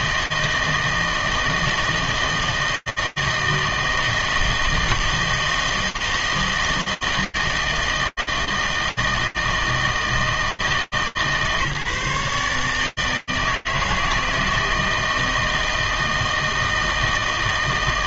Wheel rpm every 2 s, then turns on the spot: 160, 160, 160, 160, 160, 150, 150, 160, 160.
none